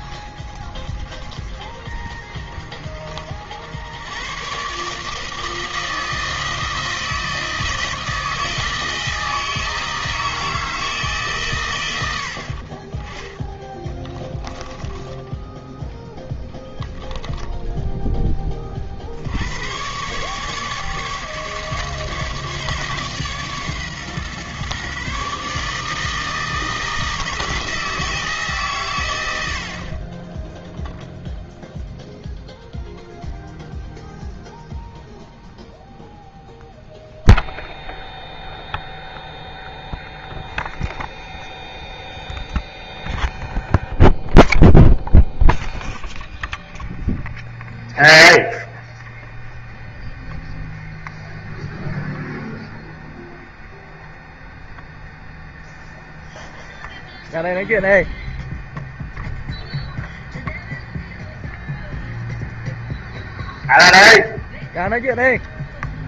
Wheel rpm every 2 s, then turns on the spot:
40, 90, 160, 160, 160, 120, 20, 10, 0, 100, 150, 130, 150, 160, 80, 0, 0, 0, 0, 0, 0, 0, 0, 0, 0, 0, 0, 0, 0, 0, 0, 0, 0.
12-14